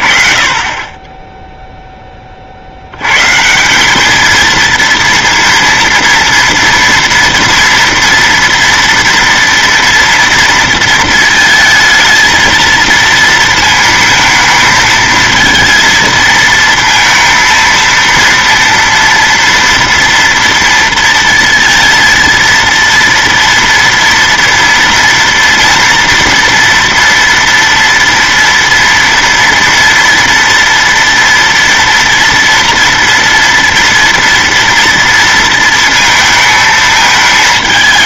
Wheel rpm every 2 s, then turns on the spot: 30, 60, 230, 230, 230, 230, 230, 220, 230, 230, 230, 230, 230, 230, 230, 230, 230, 230, 220.
none